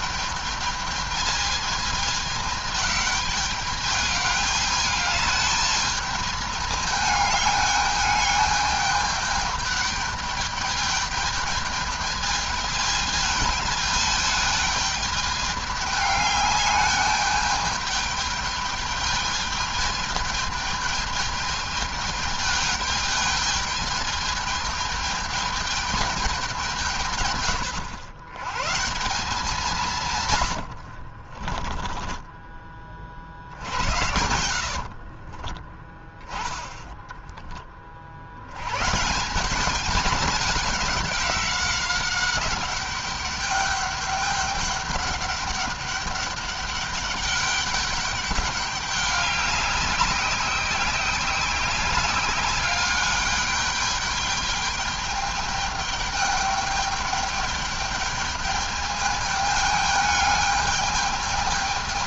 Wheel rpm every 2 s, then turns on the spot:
220, 210, 210, 210, 210, 210, 210, 210, 210, 210, 220, 210, 210, 140, 150, 60, 40, 60, 10, 160, 200, 200, 200, 200, 200, 190, 200, 210, 210, 210, 210.
30-32 34-36